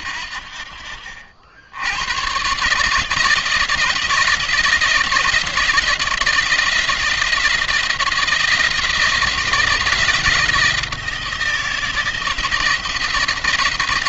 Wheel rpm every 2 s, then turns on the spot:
60, 130, 170, 170, 170, 160, 170.
none